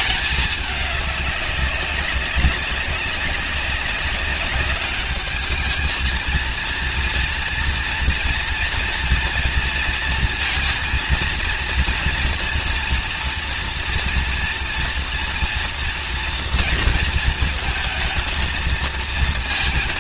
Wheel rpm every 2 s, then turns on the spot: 210, 200, 200, 230, 230, 230, 230, 240, 230, 230.
none